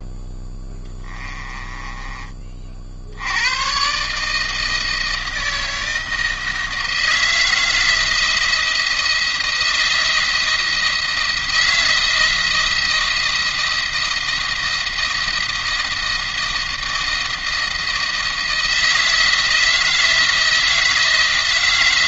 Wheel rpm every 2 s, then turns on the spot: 10, 50, 160, 160, 170, 170, 170, 170, 160, 160, 160.
0-2